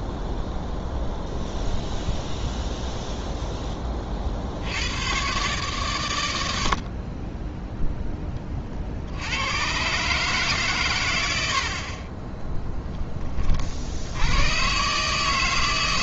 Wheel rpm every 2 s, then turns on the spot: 0, 0, 60, 80, 30, 140, 10, 110.
none